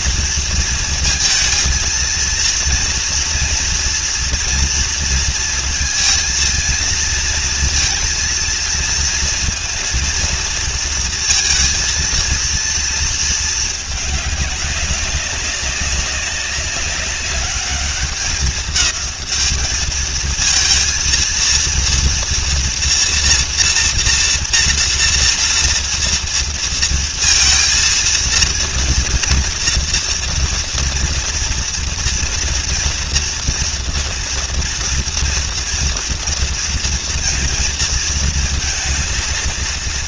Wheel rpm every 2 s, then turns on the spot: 230, 230, 230, 230, 230, 230, 230, 200, 200, 210, 230, 230, 240, 230, 230, 230, 230, 230, 230, 230.
none